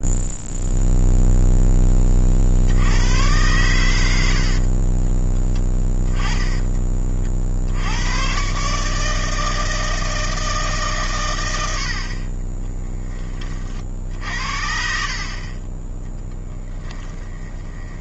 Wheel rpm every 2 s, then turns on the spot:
0, 70, 40, 20, 150, 140, 10, 60, 10.
4-6 16-18